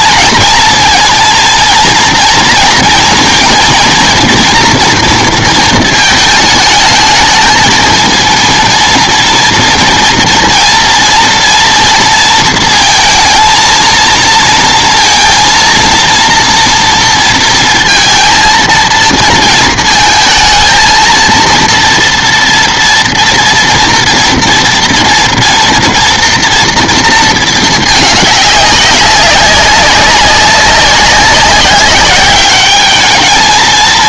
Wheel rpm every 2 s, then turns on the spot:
230, 230, 230, 220, 230, 230, 230, 230, 230, 230, 230, 230, 230, 230, 190, 200, 210.
none